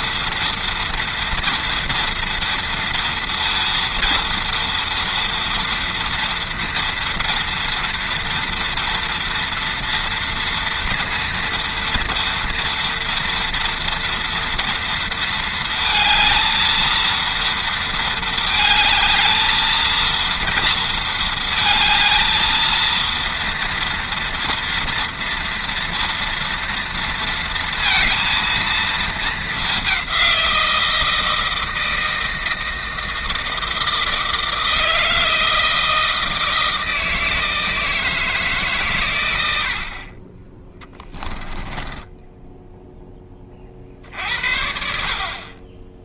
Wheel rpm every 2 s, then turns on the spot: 230, 230, 230, 230, 240, 230, 230, 230, 220, 220, 230, 230, 230, 230, 220, 170, 160, 160, 160, 140, 20, 10, 60.
40-42